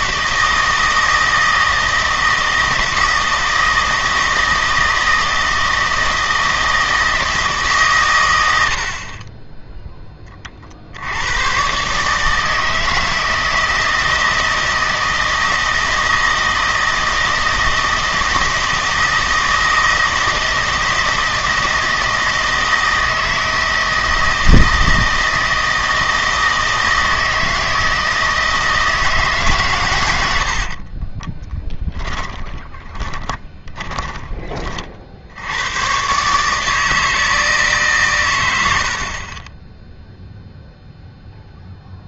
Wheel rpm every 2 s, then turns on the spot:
160, 160, 160, 160, 70, 50, 160, 160, 160, 160, 160, 160, 160, 160, 160, 50, 20, 40, 150, 90, 0.
30-34